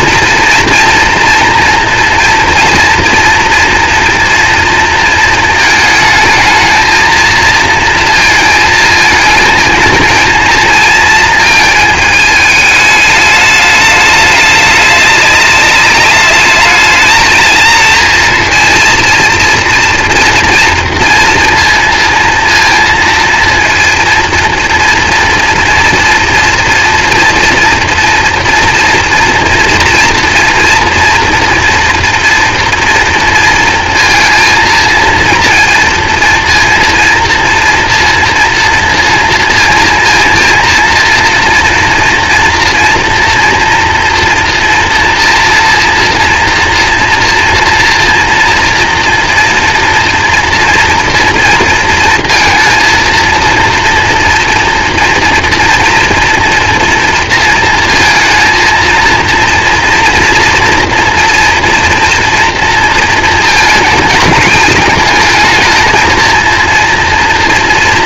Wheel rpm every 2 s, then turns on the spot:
230, 240, 230, 220, 230, 230, 210, 210, 220, 230, 230, 230, 230, 240, 230, 230, 230, 230, 230, 230, 230, 230, 230, 230, 230, 230, 230, 230, 230, 230, 230, 230, 220, 230.
none